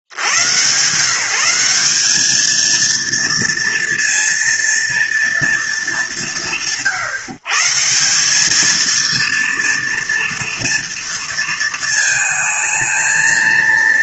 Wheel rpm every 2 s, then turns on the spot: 150, 230, 230, 150, 230, 230, 220.
none